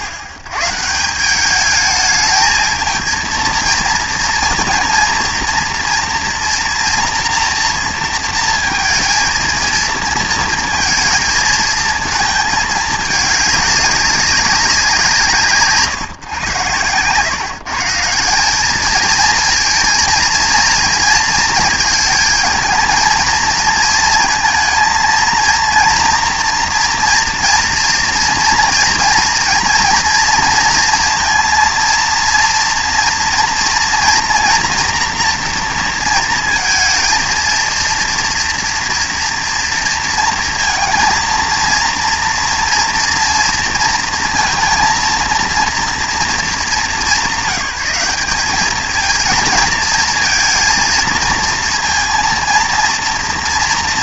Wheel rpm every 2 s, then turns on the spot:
110, 220, 230, 230, 230, 220, 220, 190, 120, 200, 230, 220, 220, 230, 230, 230, 230, 240, 230, 230, 230, 230, 230, 210, 220, 230, 230.
none